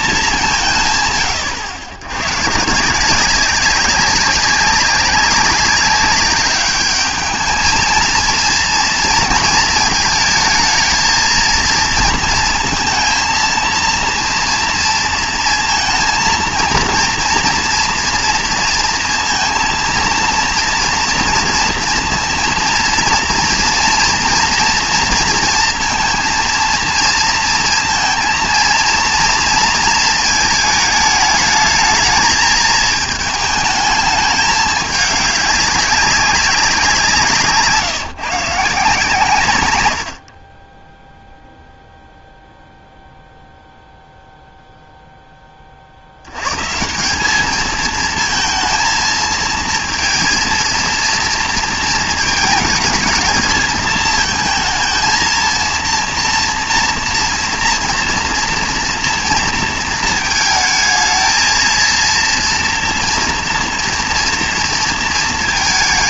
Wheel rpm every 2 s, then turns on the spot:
160, 150, 190, 200, 230, 220, 230, 230, 230, 230, 230, 230, 230, 230, 230, 220, 220, 210, 180, 160, 20, 0, 0, 140, 230, 230, 220, 230, 230, 230, 220, 230, 230.
none